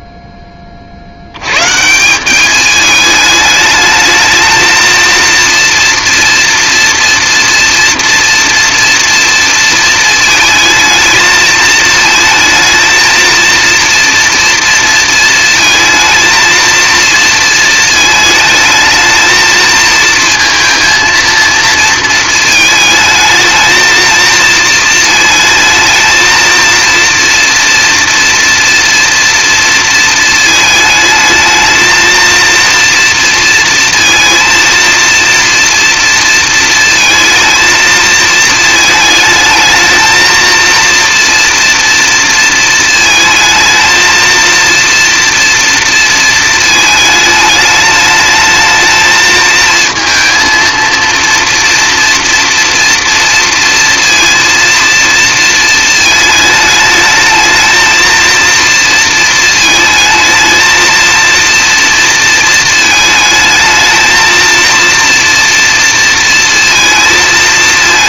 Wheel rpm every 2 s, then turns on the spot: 30, 210, 220, 230, 230, 220, 220, 230, 230, 220, 230, 220, 230, 230, 230, 220, 230, 230, 230, 220, 230, 230, 230, 220, 220, 230, 240, 230, 220, 230, 230, 220, 230, 230.
none